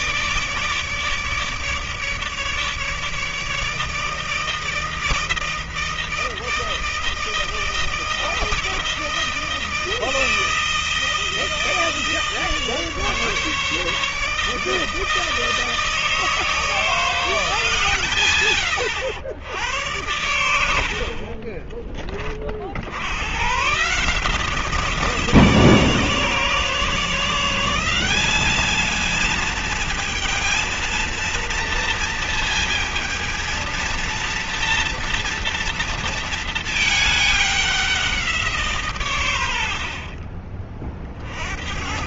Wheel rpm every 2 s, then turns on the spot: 150, 150, 160, 160, 160, 160, 150, 160, 160, 100, 60, 70, 160, 150, 220, 230, 230, 230, 220, 150, 50.
none